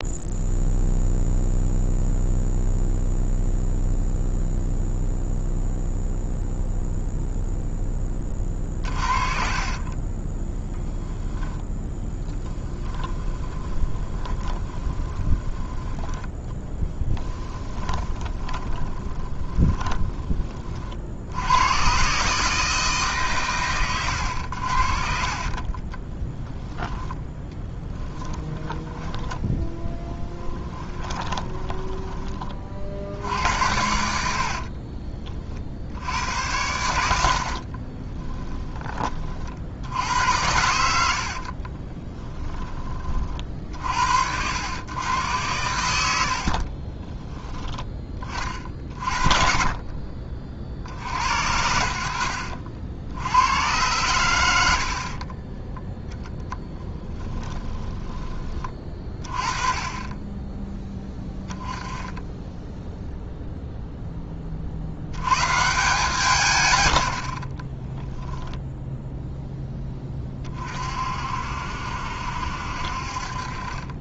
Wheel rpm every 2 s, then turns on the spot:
0, 0, 0, 0, 30, 20, 20, 20, 10, 20, 50, 150, 60, 10, 10, 20, 60, 40, 100, 20, 80, 30, 100, 20, 40, 60, 80, 40, 20, 20, 10, 0, 60, 100, 0, 40, 60.
8-20 24-28 30-32 34-36 46-48 56-58